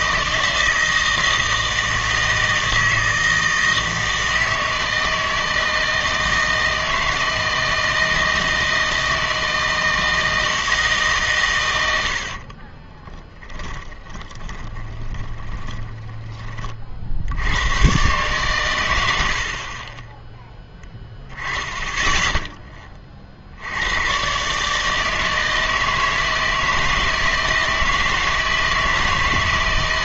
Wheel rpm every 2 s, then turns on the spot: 160, 160, 160, 160, 160, 160, 30, 20, 40, 120, 10, 10, 140, 160, 160.
12-16